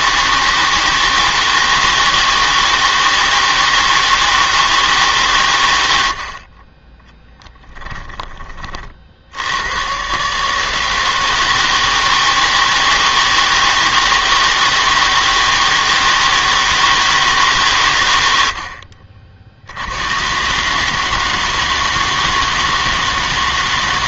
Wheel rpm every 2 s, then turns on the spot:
160, 160, 160, 30, 20, 150, 160, 170, 160, 70, 140, 160.
none